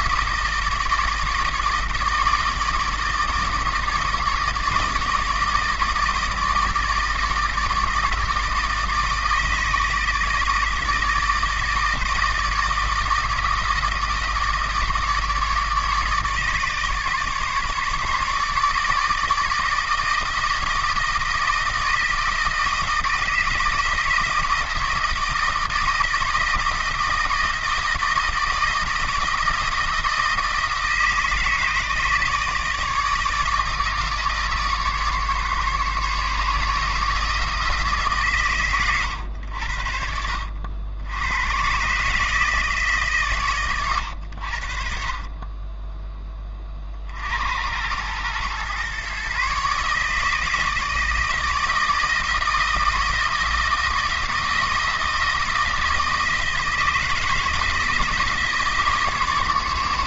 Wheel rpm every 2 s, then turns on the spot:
160, 160, 160, 160, 160, 160, 160, 150, 150, 150, 160, 160, 160, 160, 160, 160, 150, 140, 150, 120, 80, 150, 60, 40, 120, 160, 160, 160, 160, 150.
none